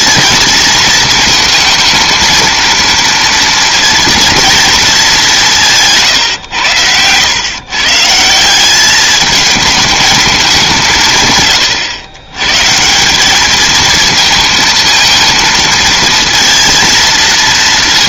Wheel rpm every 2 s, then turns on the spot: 230, 230, 230, 110, 180, 200, 130, 230, 230.
none